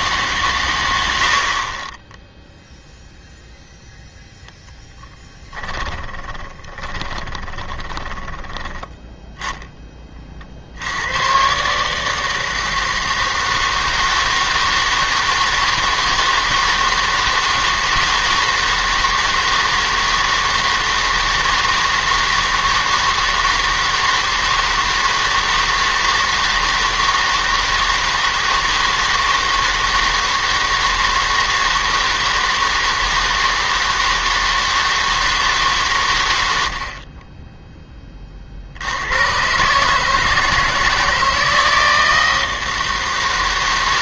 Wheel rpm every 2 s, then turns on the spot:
120, 0, 0, 30, 10, 70, 160, 160, 160, 160, 160, 160, 160, 160, 160, 160, 160, 160, 70, 80, 160, 160.
6-8